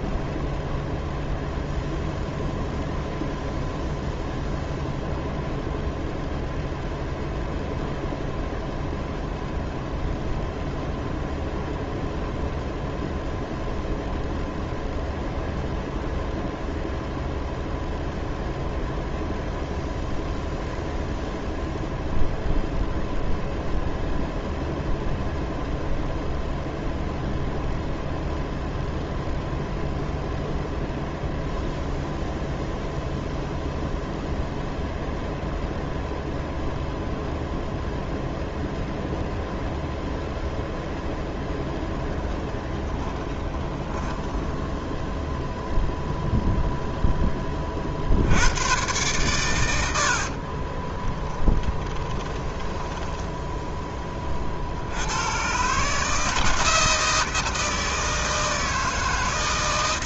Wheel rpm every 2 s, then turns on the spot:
0, 0, 0, 0, 0, 0, 0, 0, 0, 0, 0, 0, 0, 0, 0, 0, 0, 0, 0, 0, 0, 10, 10, 0, 120, 30, 10, 70, 160, 160.
42-46 50-54